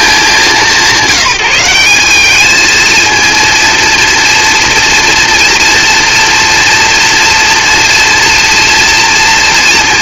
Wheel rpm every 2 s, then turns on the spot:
180, 230, 230, 230, 230.
none